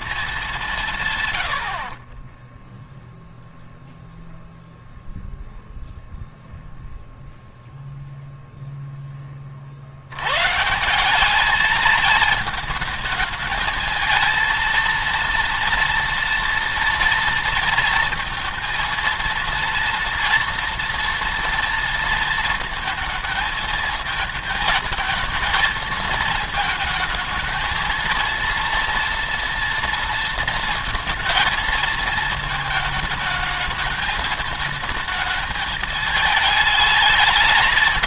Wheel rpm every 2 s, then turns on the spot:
200, 10, 0, 0, 0, 140, 220, 220, 230, 230, 230, 230, 220, 220, 230, 230, 230, 220, 220.
none